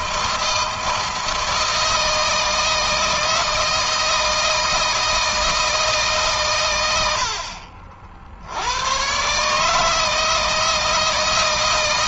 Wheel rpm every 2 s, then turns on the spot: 160, 160, 160, 110, 90, 160.
none